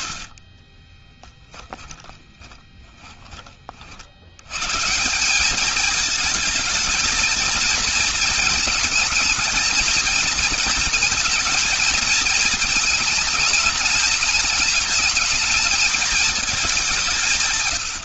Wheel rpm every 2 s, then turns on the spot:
20, 20, 150, 220, 220, 230, 220, 220, 190.
0-4